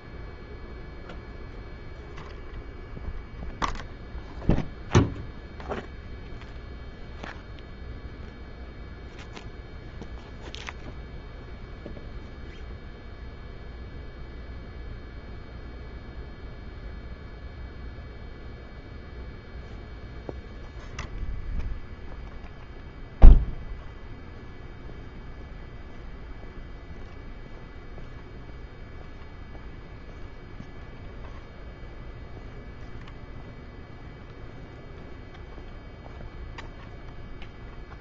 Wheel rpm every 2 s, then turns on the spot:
0, 0, 0, 0, 0, 0, 0, 0, 0, 0, 0, 0, 0, 0, 0, 0, 0, 0, 0.
none